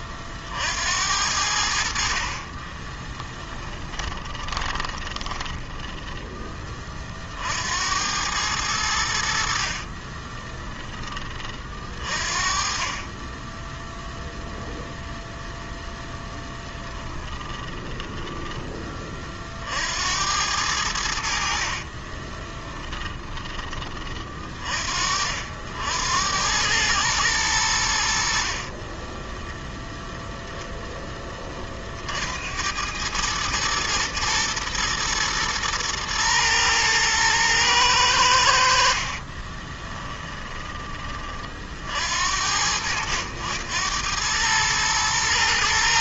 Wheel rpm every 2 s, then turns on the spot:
80, 10, 20, 30, 80, 20, 20, 0, 10, 30, 80, 20, 50, 110, 20, 10, 100, 120, 110, 40, 20, 90, 110.
2-6 16-18 22-24 28-30 38-40